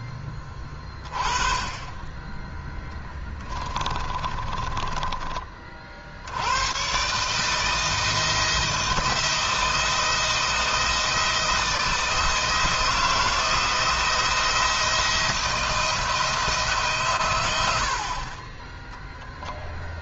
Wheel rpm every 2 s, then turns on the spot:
20, 10, 20, 120, 170, 160, 170, 170, 140, 0.
2-6